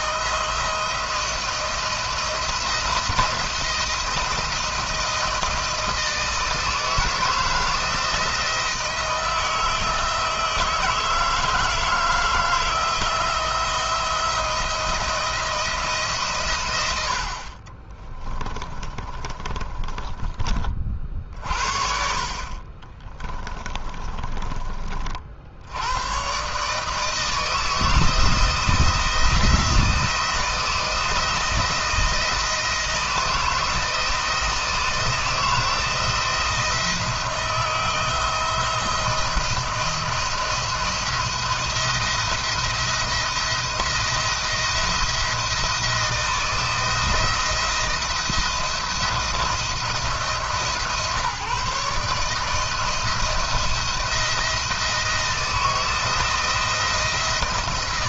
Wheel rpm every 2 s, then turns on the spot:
160, 170, 160, 160, 160, 160, 160, 170, 120, 20, 30, 40, 30, 140, 160, 160, 160, 170, 170, 170, 170, 170, 170, 160, 170, 160, 160, 160, 160.
18-20 22-24